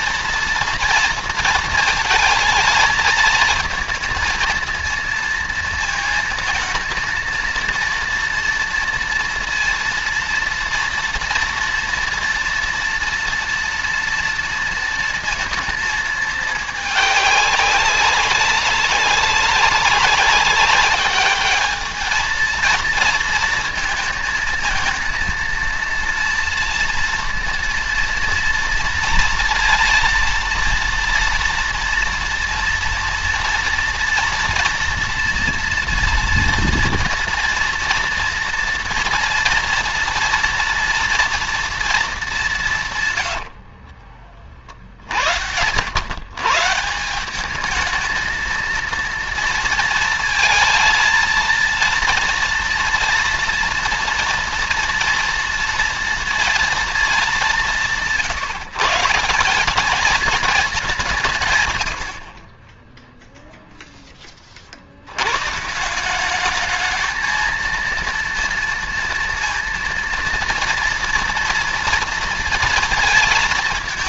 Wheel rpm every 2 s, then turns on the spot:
230, 220, 230, 230, 230, 230, 230, 230, 210, 200, 210, 230, 220, 230, 230, 230, 230, 230, 230, 230, 230, 150, 60, 160, 230, 230, 230, 230, 220, 170, 190, 10, 80, 220, 230, 230, 230.
42-44